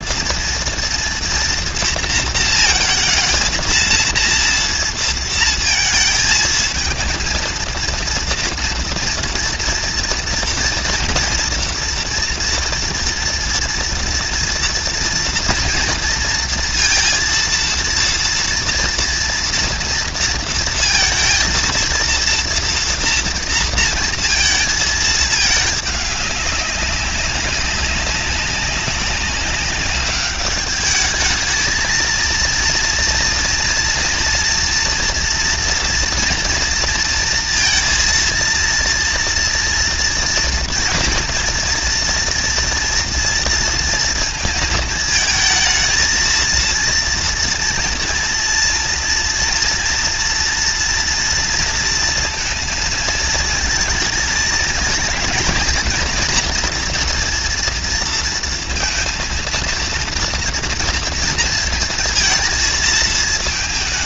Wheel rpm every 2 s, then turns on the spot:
230, 230, 230, 220, 240, 230, 230, 230, 230, 230, 230, 230, 220, 200, 190, 210, 230, 230, 230, 230, 240, 240, 220, 230, 230, 230, 230, 230, 240, 230, 230, 230.
none